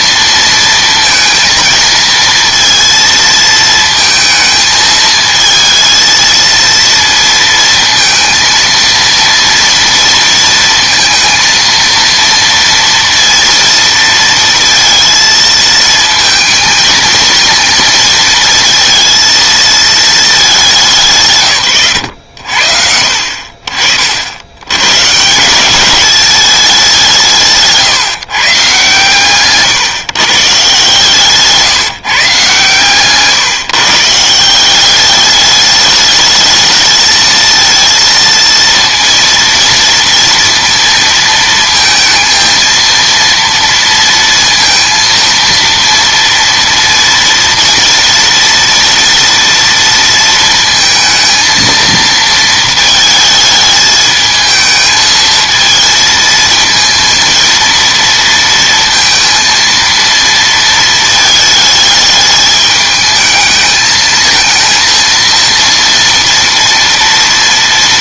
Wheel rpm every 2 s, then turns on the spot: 230, 230, 220, 230, 230, 230, 230, 230, 220, 230, 200, 70, 110, 200, 140, 140, 140, 180, 220, 230, 230, 230, 230, 230, 230, 230, 220, 220, 230, 230, 230, 220, 230, 230.
none